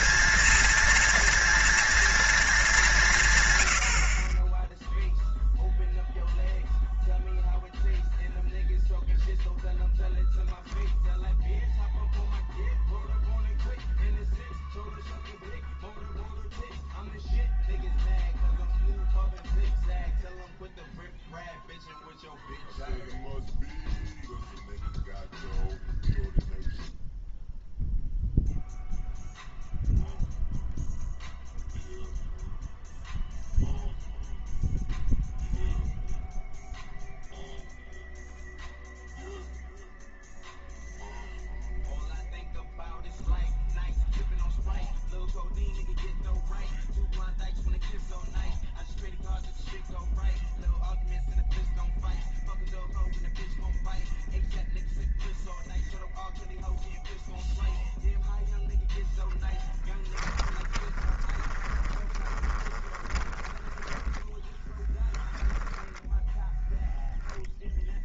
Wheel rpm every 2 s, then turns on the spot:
230, 210, 20, 0, 0, 0, 0, 0, 0, 0, 0, 0, 0, 0, 0, 0, 0, 0, 0, 0, 0, 0, 0, 0, 0, 0, 0, 0, 0, 0, 20, 20, 10, 10.
60-64